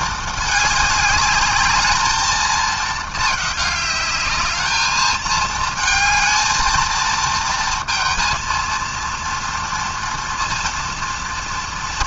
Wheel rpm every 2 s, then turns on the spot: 210, 220, 220, 230, 230, 230.
none